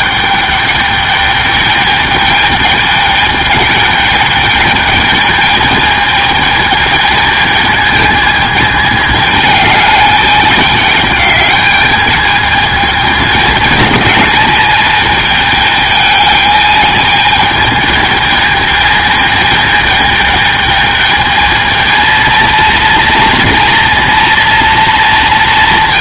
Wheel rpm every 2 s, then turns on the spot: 210, 210, 210, 210, 210, 210, 210, 220, 210, 220, 220, 230, 230.
none